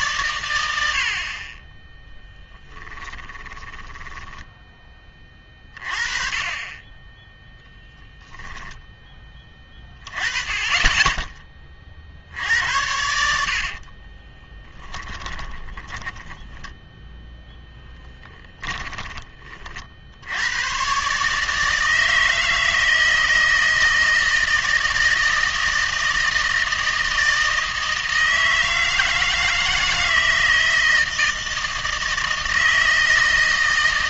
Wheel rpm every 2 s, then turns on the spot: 90, 10, 10, 20, 10, 20, 80, 20, 0, 10, 120, 160, 160, 160, 160, 160, 160.
2-4 8-10 14-16 18-20